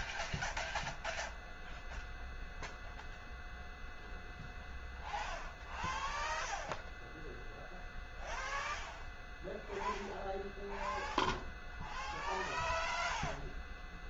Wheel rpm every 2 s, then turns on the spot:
0, 0, 0, 0, 0, 0, 0.
none